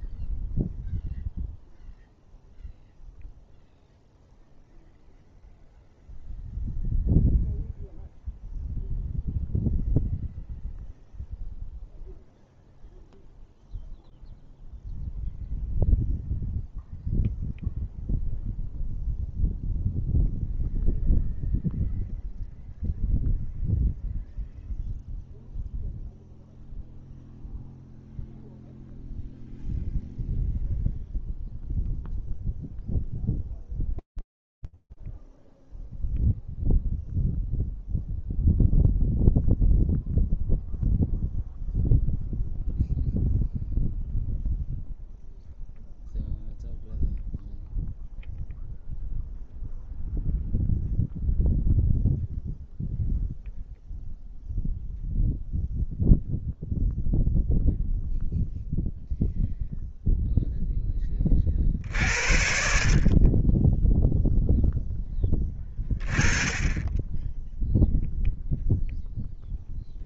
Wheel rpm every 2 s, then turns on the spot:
0, 0, 0, 0, 0, 0, 0, 0, 0, 0, 0, 0, 0, 0, 0, 0, 0, 0, 0, 0, 0, 0, 0, 0, 0, 0, 0, 0, 0, 0, 20, 20, 10, 10, 0.
none